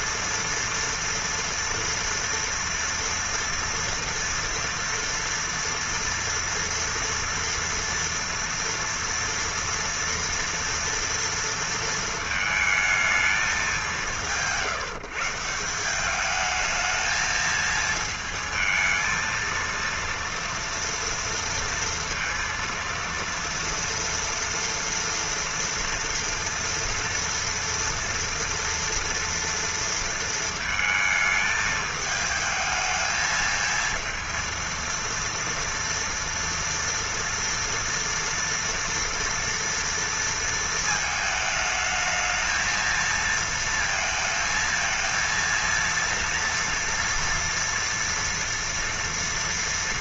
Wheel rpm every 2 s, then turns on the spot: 230, 230, 230, 230, 230, 230, 220, 170, 220, 220, 230, 230, 230, 230, 230, 220, 220, 230, 230, 230, 220, 220, 230, 230, 230.
none